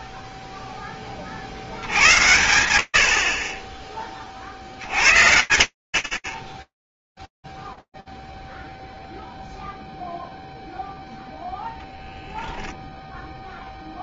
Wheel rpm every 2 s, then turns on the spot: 0, 80, 60, 0, 0, 0, 0.
none